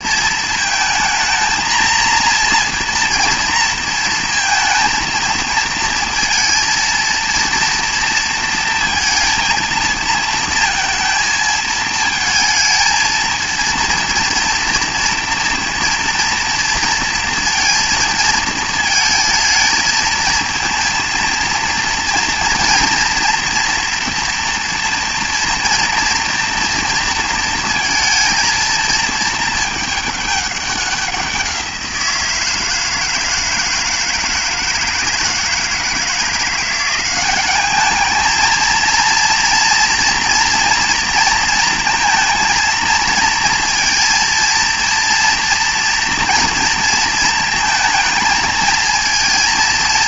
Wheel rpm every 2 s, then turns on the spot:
230, 230, 230, 230, 230, 230, 220, 240, 230, 220, 230, 230, 230, 230, 220, 200, 170, 160, 170, 230, 240, 230, 230, 230, 220.
none